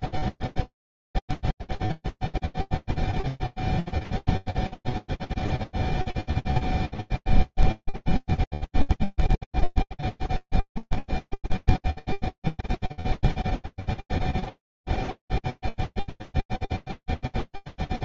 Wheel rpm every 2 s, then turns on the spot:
0, 0, 0, 0, 0, 0, 0, 0, 0.
none